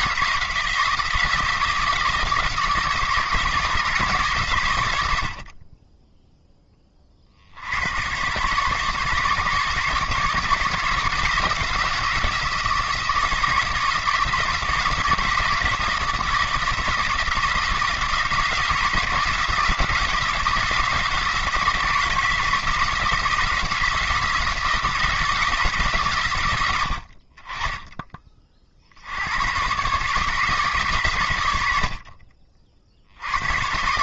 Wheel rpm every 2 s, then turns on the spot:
170, 170, 110, 10, 140, 150, 160, 160, 160, 170, 170, 160, 160, 80, 50, 140, 60.
26-28